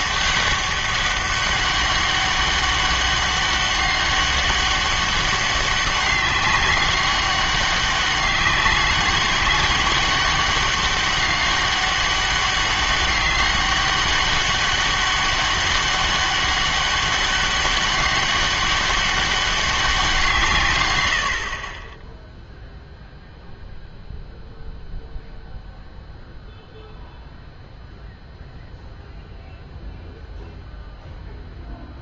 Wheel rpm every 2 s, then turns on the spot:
200, 200, 200, 190, 200, 200, 200, 200, 200, 200, 130, 0, 0, 0, 0, 0.
none